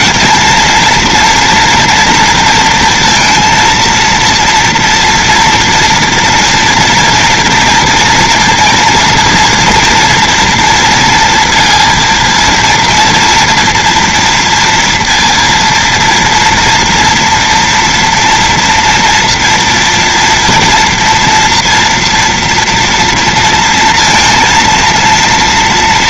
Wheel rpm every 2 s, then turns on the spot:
230, 230, 230, 240, 230, 240, 230, 230, 230, 230, 230, 230, 230.
none